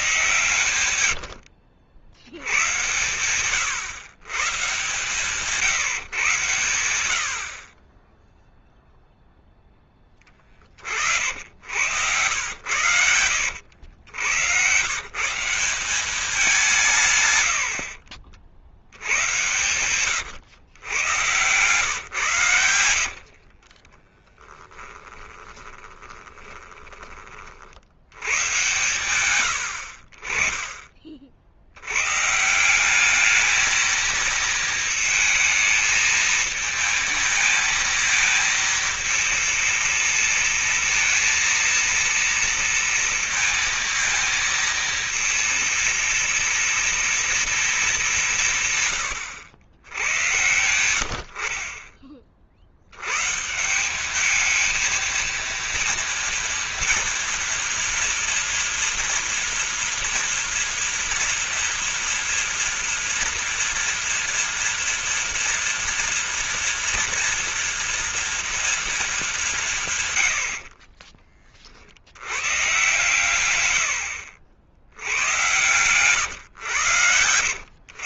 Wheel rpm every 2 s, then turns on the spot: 110, 100, 130, 110, 0, 40, 90, 110, 180, 60, 110, 110, 10, 20, 120, 30, 170, 230, 220, 220, 230, 230, 230, 230, 150, 100, 60, 220, 230, 230, 230, 230, 230, 230, 230, 60, 120, 70, 120.
0-2 24-28 70-72